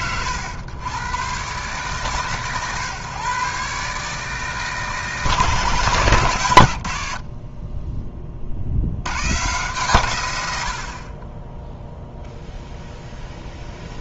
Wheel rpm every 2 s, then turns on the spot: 110, 130, 150, 100, 80, 50, 0.
none